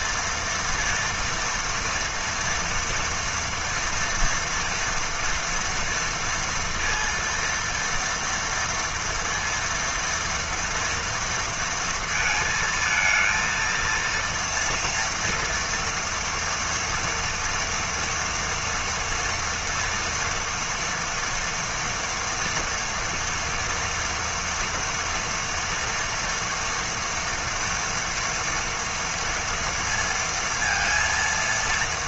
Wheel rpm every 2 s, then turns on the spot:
230, 230, 230, 230, 230, 230, 220, 230, 230, 230, 230, 230, 230, 230, 230, 230.
none